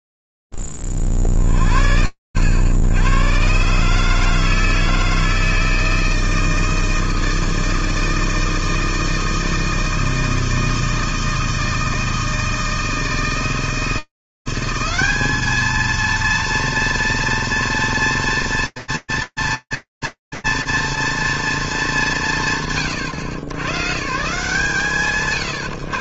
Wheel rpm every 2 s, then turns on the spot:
0, 70, 160, 160, 160, 160, 160, 200, 230, 230, 230, 140, 160.
none